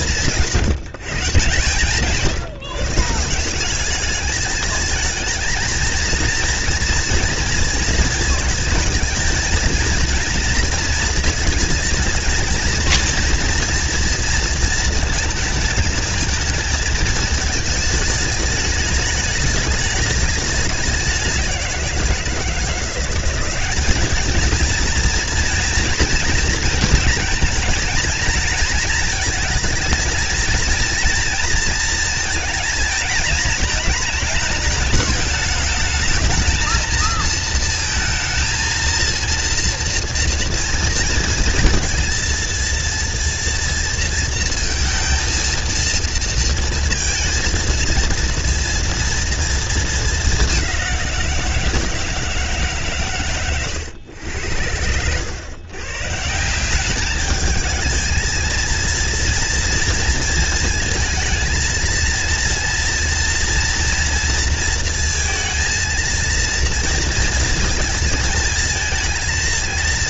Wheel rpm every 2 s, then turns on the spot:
180, 160, 210, 230, 220, 230, 230, 220, 220, 210, 200, 170, 220, 230, 230, 230, 230, 210, 220, 220, 230, 230, 230, 230, 230, 190, 150, 90, 180, 230, 220, 230, 220, 230, 220.
none